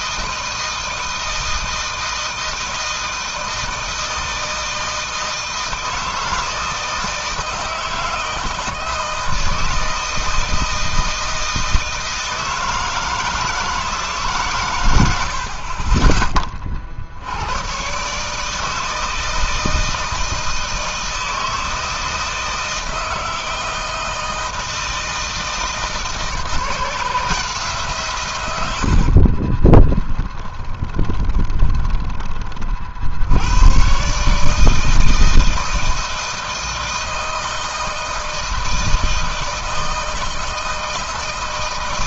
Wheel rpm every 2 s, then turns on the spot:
160, 160, 160, 160, 160, 160, 160, 80, 70, 160, 160, 160, 160, 160, 40, 20, 70, 160, 160, 160, 160.
28-32